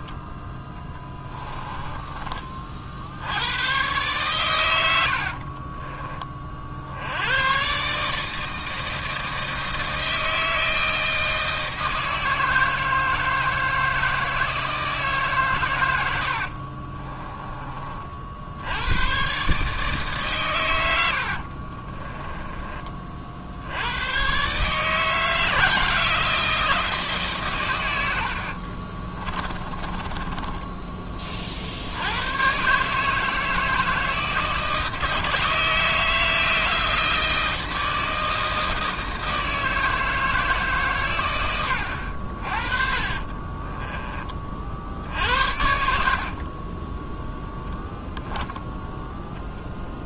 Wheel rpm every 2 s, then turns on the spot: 20, 40, 100, 60, 160, 160, 160, 160, 50, 90, 90, 20, 150, 160, 50, 20, 140, 160, 160, 160, 140, 50, 50, 20, 0.
0-2 16-18 28-32 42-44 46-48